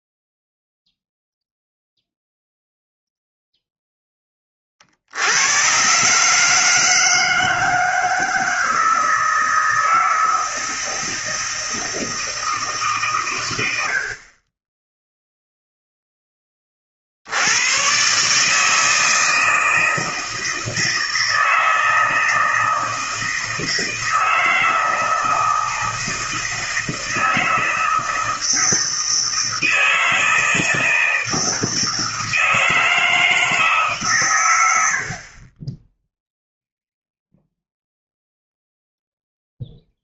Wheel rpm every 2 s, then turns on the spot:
0, 0, 30, 150, 160, 160, 150, 20, 30, 150, 160, 160, 160, 160, 160, 160, 160, 90, 0, 0.
none